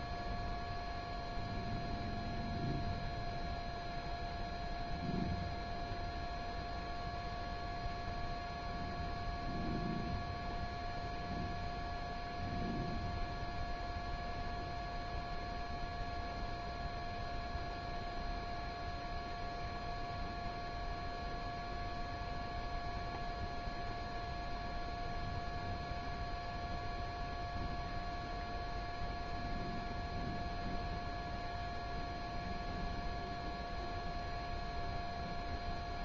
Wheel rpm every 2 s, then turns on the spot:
0, 0, 0, 0, 0, 0, 0, 0, 0, 0, 0, 0, 0, 0, 0, 0, 0, 0.
none